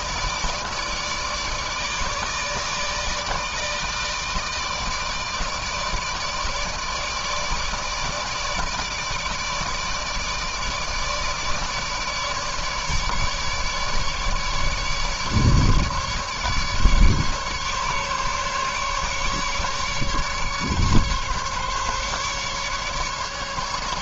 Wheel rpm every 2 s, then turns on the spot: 160, 150, 150, 150, 150, 160, 150, 150, 150, 150, 140, 150.
none